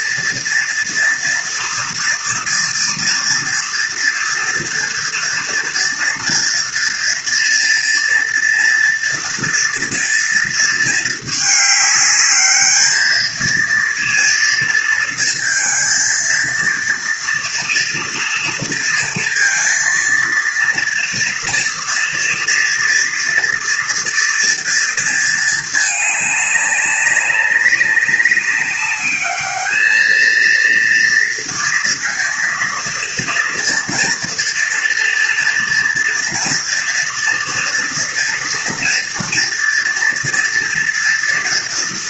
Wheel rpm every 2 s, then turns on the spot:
230, 230, 230, 230, 230, 220, 210, 230, 230, 230, 230, 230, 230, 200, 200, 230, 230, 230, 230, 240, 230.
none